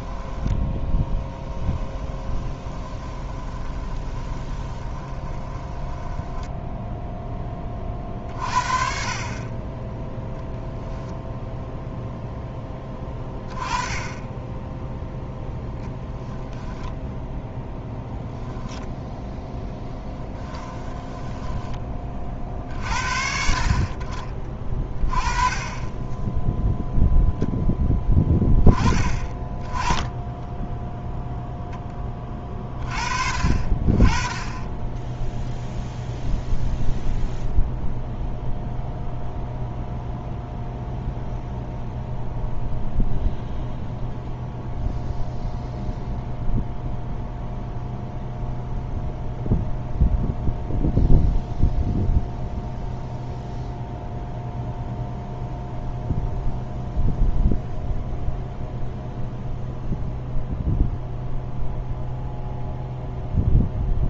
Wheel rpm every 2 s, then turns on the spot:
10, 20, 20, 0, 40, 0, 10, 10, 0, 0, 10, 50, 30, 0, 10, 0, 30, 20, 0, 0, 0, 0, 0, 0, 0, 0, 0, 0, 0, 0, 0, 0.
0-6 20-22